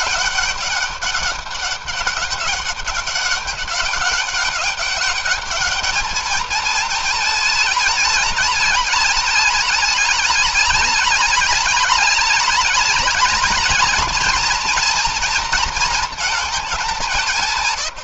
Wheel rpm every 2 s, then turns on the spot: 200, 200, 200, 220, 210, 210, 210, 230, 190.
none